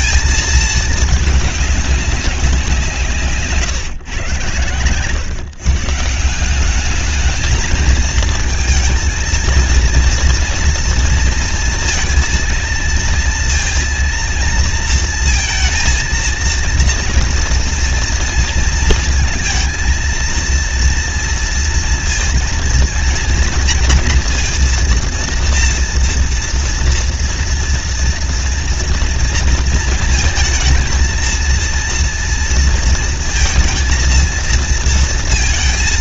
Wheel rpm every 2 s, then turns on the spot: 220, 190, 120, 180, 220, 230, 230, 230, 230, 230, 230, 230, 240, 230, 230, 220, 230, 230.
none